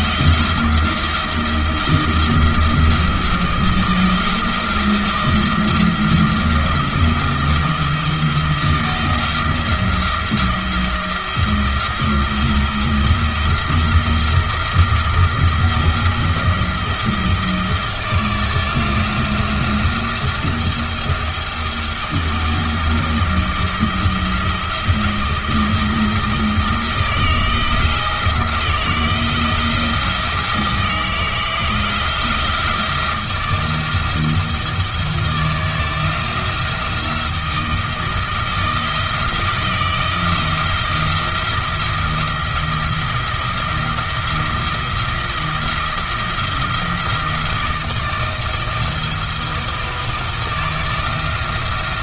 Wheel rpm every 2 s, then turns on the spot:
170, 170, 170, 170, 170, 170, 170, 170, 170, 170, 170, 170, 170, 170, 170, 170, 170, 160, 160, 160, 170, 170, 170, 170, 160, 160.
none